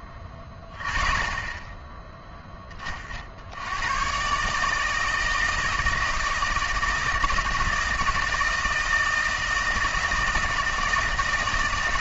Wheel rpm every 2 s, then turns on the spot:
20, 50, 160, 160, 160, 160.
none